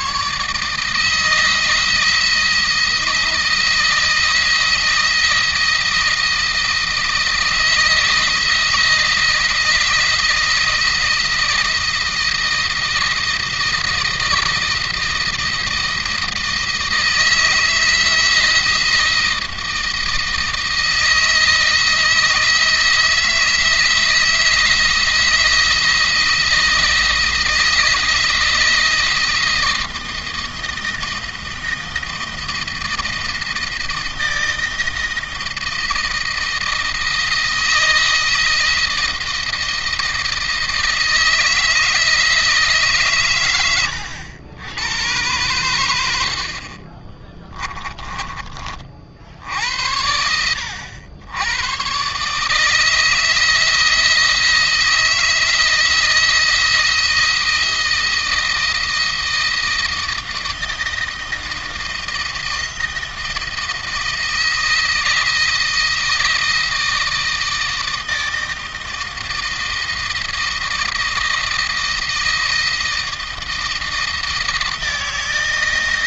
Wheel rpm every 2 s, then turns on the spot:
150, 160, 160, 160, 170, 170, 160, 160, 160, 160, 160, 160, 160, 160, 160, 160, 160, 160, 160, 160, 160, 150, 90, 40, 40, 80, 150, 160, 170, 170, 160, 160, 160, 160, 160, 160, 160, 160.
none